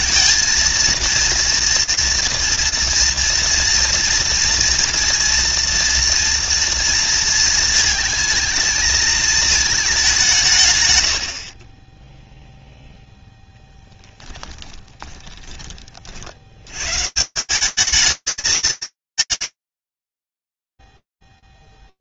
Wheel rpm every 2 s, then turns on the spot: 230, 230, 230, 230, 220, 100, 0, 20, 180, 220, 40.
none